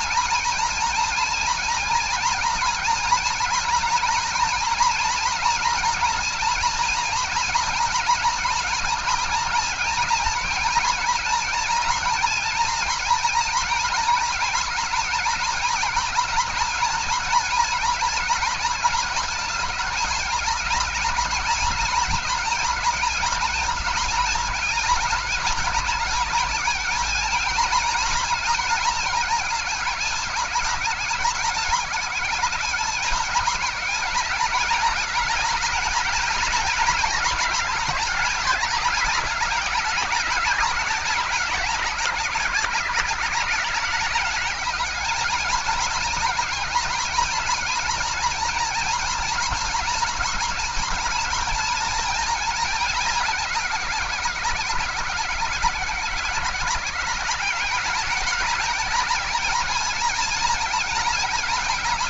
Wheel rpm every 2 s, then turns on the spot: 230, 230, 230, 230, 220, 230, 230, 220, 230, 220, 220, 230, 200, 220, 220, 200, 210, 210, 220, 210, 200, 180, 210, 240, 230, 230, 210, 180, 180, 210, 220.
none